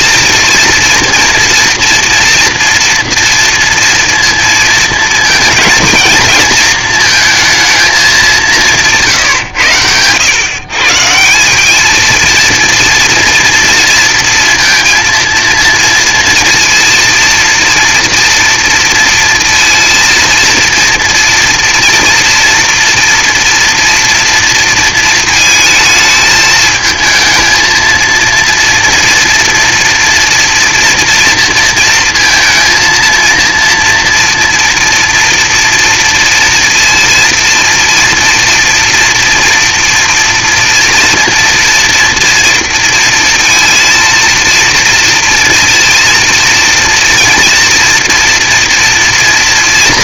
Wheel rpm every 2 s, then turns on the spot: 230, 230, 220, 230, 160, 130, 230, 230, 230, 230, 230, 230, 230, 220, 230, 230, 230, 240, 230, 230, 230, 230, 230, 230, 230.
none